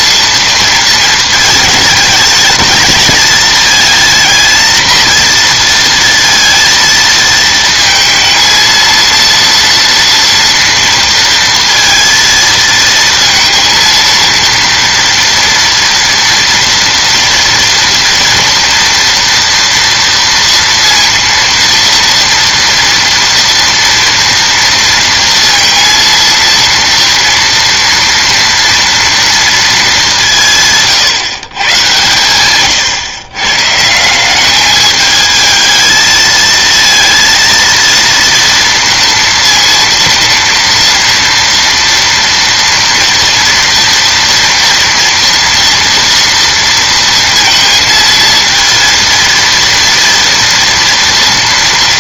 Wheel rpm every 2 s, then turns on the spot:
230, 220, 230, 230, 230, 230, 230, 230, 230, 230, 230, 230, 230, 230, 230, 150, 120, 210, 230, 230, 230, 230, 230, 230, 230, 230.
none